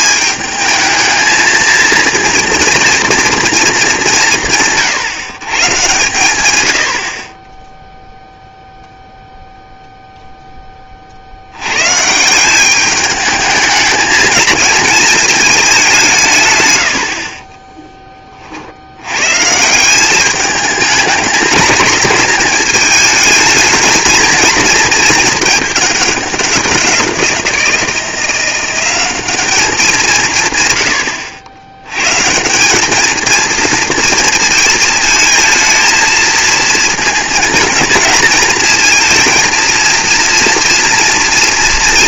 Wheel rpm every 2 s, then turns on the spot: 220, 230, 150, 90, 0, 20, 200, 220, 110, 60, 220, 230, 230, 180, 190, 130, 190, 230, 220, 230, 230.
16-18